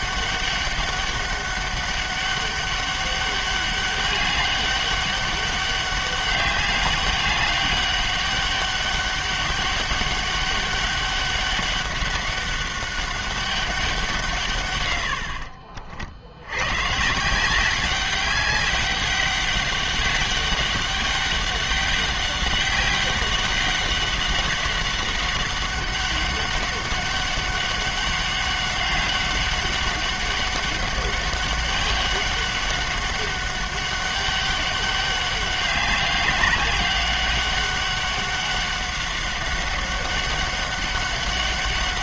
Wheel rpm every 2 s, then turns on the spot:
200, 200, 200, 200, 200, 200, 200, 120, 120, 190, 200, 200, 190, 200, 200, 190, 200, 200, 190, 200, 200.
none